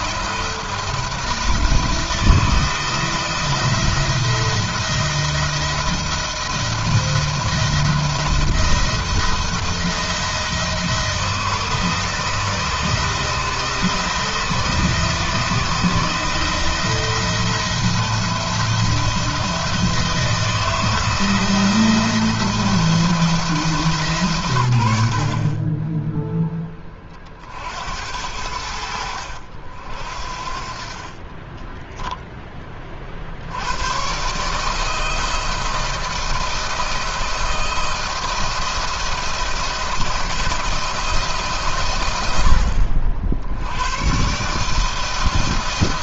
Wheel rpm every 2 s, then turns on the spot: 170, 170, 170, 170, 170, 160, 160, 160, 170, 170, 160, 160, 70, 20, 80, 30, 30, 160, 160, 170, 170, 70, 160.
none